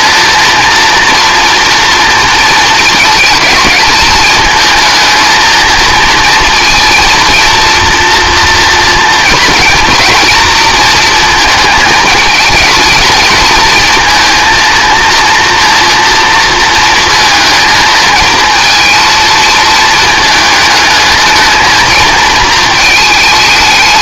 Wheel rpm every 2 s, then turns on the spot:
230, 230, 230, 230, 230, 220, 220, 230, 230, 220, 220, 220.
none